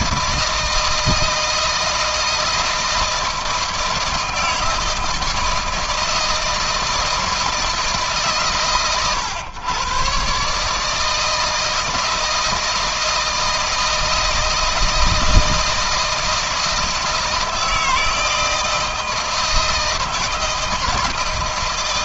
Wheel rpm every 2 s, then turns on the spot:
160, 160, 160, 170, 130, 160, 160, 160, 160, 160, 160.
none